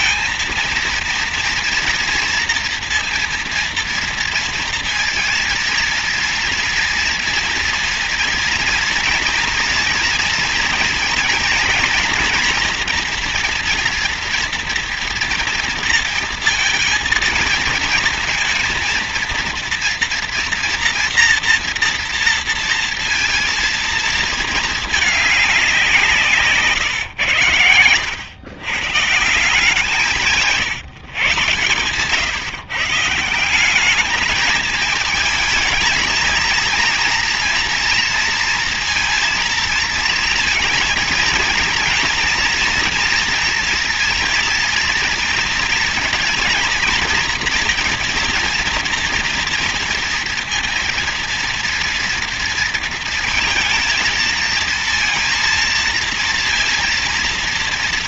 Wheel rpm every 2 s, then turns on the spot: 230, 230, 230, 230, 230, 230, 230, 230, 230, 230, 230, 230, 210, 130, 140, 150, 160, 220, 230, 230, 220, 230, 230, 230, 230, 230, 230, 230, 230.
none